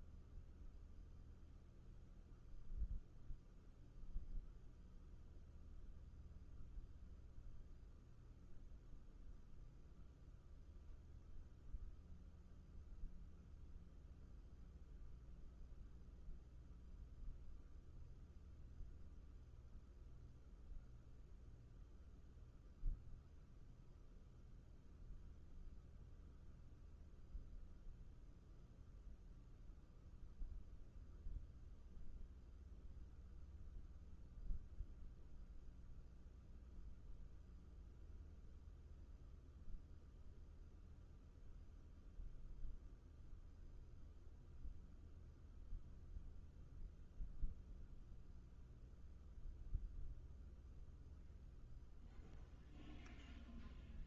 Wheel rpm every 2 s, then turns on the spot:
0, 0, 0, 0, 0, 0, 0, 0, 0, 0, 0, 0, 0, 0, 0, 0, 0, 0, 0, 0, 0, 0, 0, 0, 0, 0, 0.
none